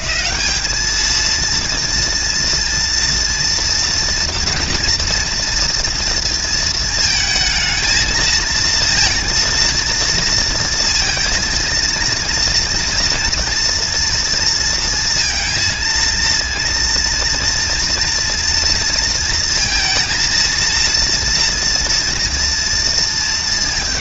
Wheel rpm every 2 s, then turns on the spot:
130, 240, 240, 230, 230, 230, 230, 230, 230, 230, 230, 230.
none